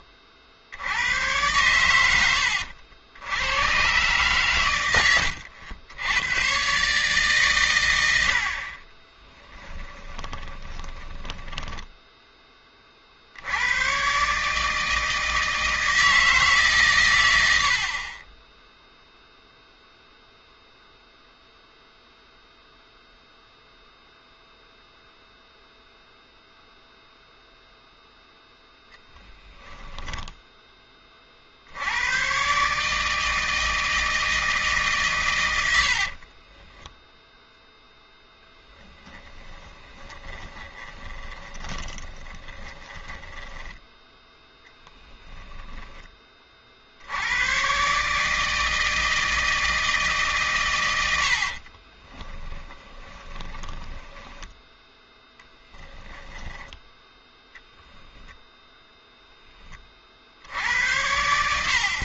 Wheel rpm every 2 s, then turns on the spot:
80, 80, 110, 130, 40, 20, 40, 160, 150, 10, 0, 0, 0, 0, 0, 10, 140, 150, 20, 0, 20, 20, 10, 50, 160, 120, 20, 10, 10, 0, 80.
10-12 18-20 36-38 40-46 52-54